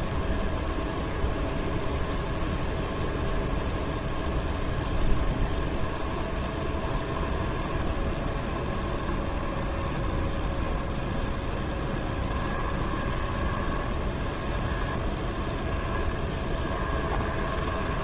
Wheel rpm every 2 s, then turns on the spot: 0, 0, 0, 10, 10, 0, 20, 10, 10.
6-10 12-18